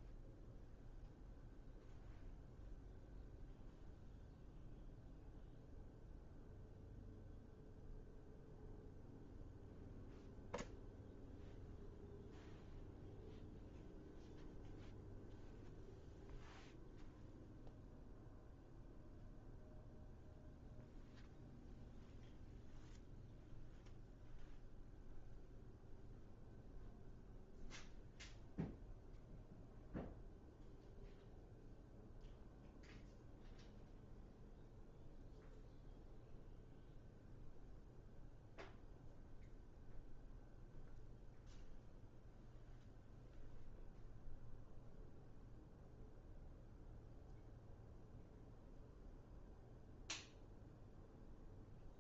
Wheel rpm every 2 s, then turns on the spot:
0, 0, 0, 0, 0, 0, 0, 0, 0, 0, 0, 0, 0, 0, 0, 0, 0, 0, 0, 0, 0, 0, 0, 0, 0, 0.
none